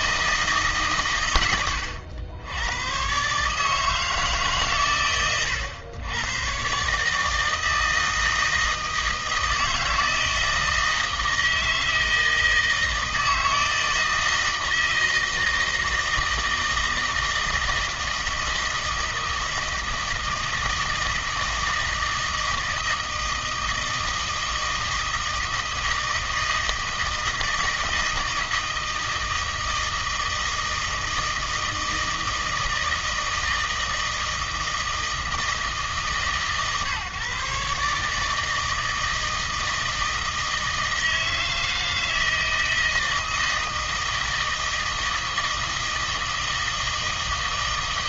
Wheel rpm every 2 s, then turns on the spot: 150, 100, 130, 130, 160, 160, 160, 160, 160, 160, 160, 160, 160, 160, 160, 160, 160, 160, 140, 160, 160, 160, 160, 160.
none